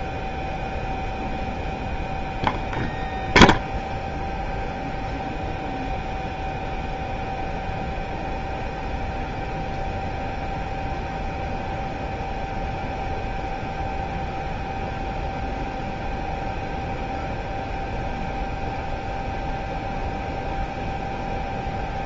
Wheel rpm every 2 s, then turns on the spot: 0, 0, 0, 0, 0, 0, 0, 0, 0, 0, 0.
none